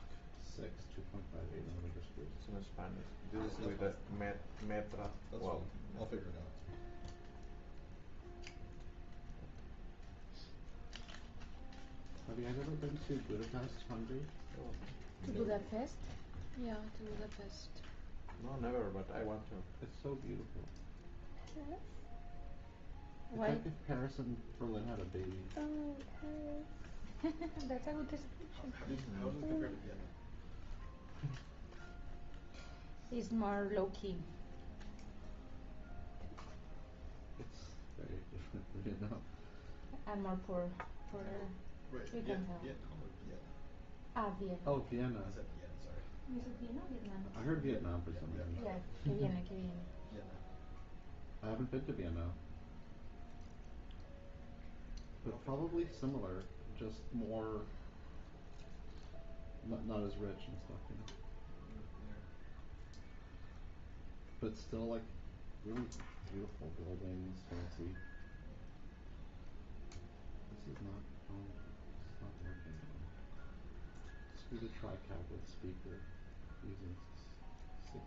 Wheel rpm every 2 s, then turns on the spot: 0, 0, 0, 0, 0, 0, 0, 0, 0, 0, 0, 0, 0, 0, 0, 0, 0, 0, 0, 0, 0, 0, 0, 0, 0, 0, 0, 0, 0, 0, 0, 0, 0, 0, 0, 0, 0, 0, 0.
none